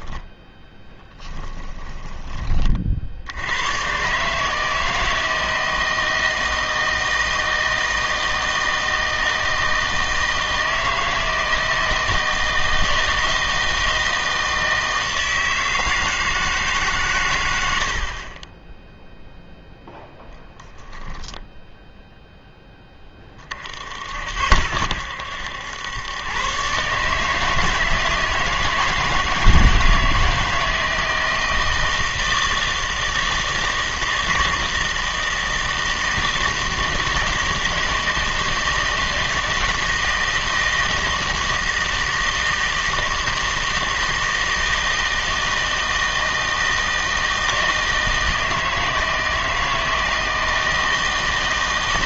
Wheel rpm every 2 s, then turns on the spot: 10, 40, 160, 160, 160, 160, 160, 160, 150, 10, 10, 10, 90, 140, 160, 160, 160, 160, 160, 160, 160, 160, 160, 160, 160, 160.
0-2 20-22